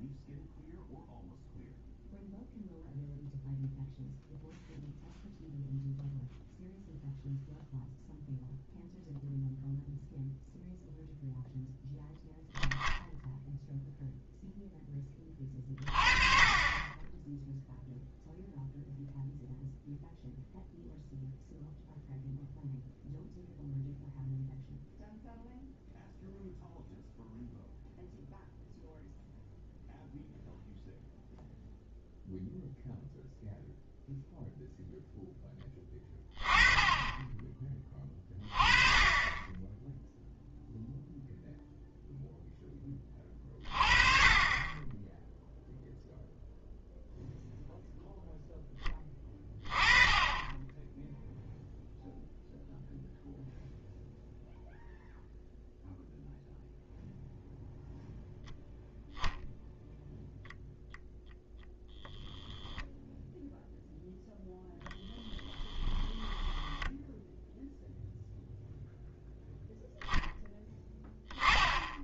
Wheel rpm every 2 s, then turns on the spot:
0, 0, 0, 0, 0, 0, 0, 10, 20, 0, 0, 0, 0, 0, 0, 0, 0, 0, 20, 30, 0, 20, 10, 0, 10, 10, 0, 0, 0, 0, 0, 0, 0, 10, 0, 10.
66-68